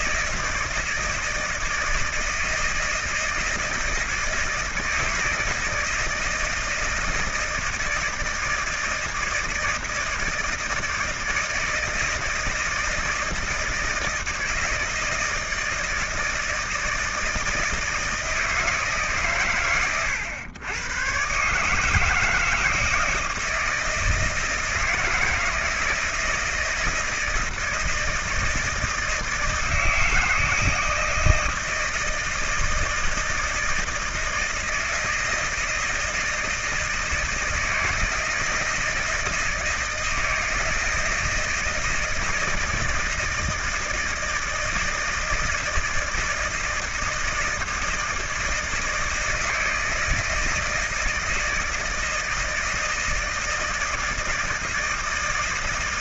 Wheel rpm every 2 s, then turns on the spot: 160, 160, 160, 160, 160, 160, 160, 160, 160, 140, 120, 160, 160, 160, 160, 160, 160, 160, 160, 170, 160, 160, 160, 160, 160, 160, 160, 160.
none